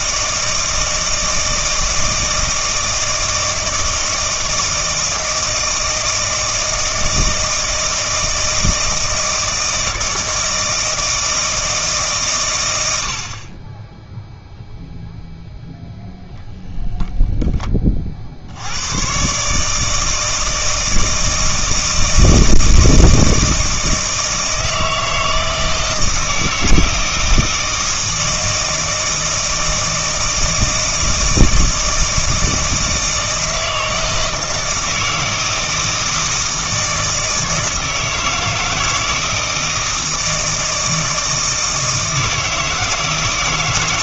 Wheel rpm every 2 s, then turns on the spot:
160, 160, 160, 160, 160, 160, 80, 0, 0, 100, 160, 160, 160, 160, 160, 160, 160, 160, 160, 160, 160, 160.
none